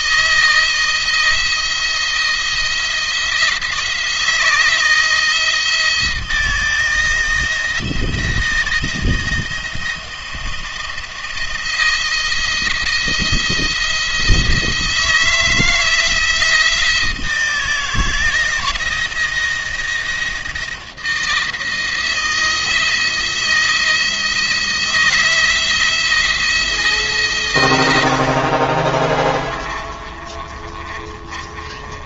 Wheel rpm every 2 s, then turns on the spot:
160, 170, 170, 170, 170, 170, 170, 170, 160, 160, 170, 160, 160, 160, 50, 30.
28-32